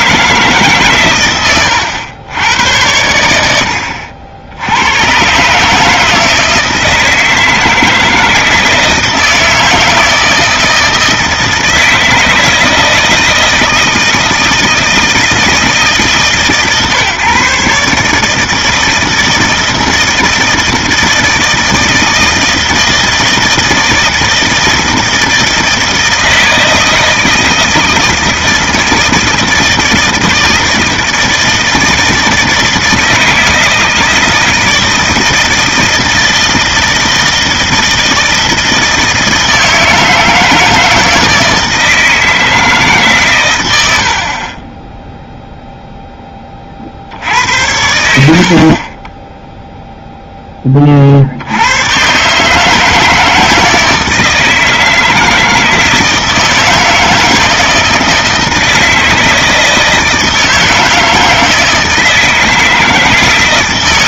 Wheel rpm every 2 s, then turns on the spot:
140, 80, 100, 160, 160, 160, 160, 160, 140, 160, 160, 160, 160, 160, 160, 160, 160, 160, 160, 160, 160, 150, 10, 50, 30, 30, 160, 160, 160, 160, 160, 160.
none